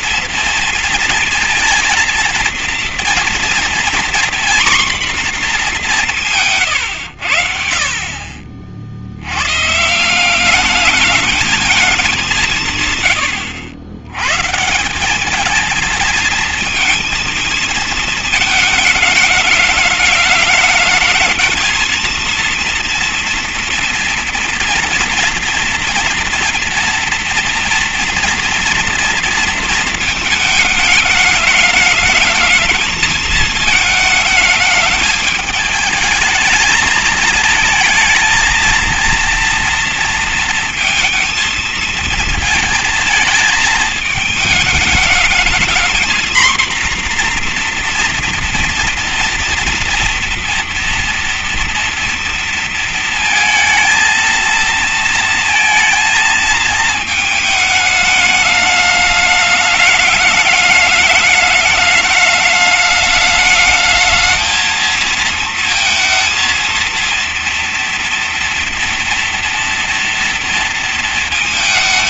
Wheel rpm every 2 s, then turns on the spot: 230, 230, 250, 160, 50, 190, 170, 150, 230, 220, 210, 230, 240, 230, 230, 220, 220, 210, 220, 230, 230, 230, 220, 240, 240, 230, 230, 230, 230, 210, 210, 210, 220, 230, 240, 230.
none